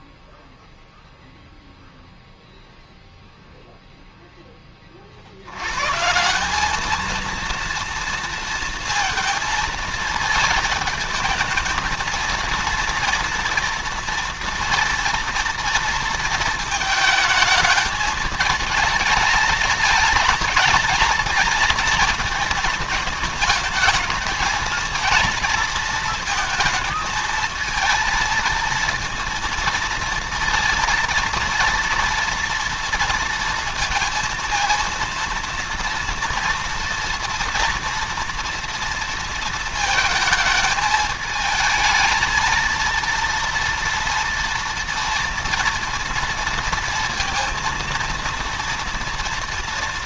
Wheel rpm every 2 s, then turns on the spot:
0, 0, 10, 190, 230, 220, 230, 230, 220, 220, 220, 220, 230, 220, 230, 230, 230, 230, 230, 230, 220, 230, 230, 230, 230.
none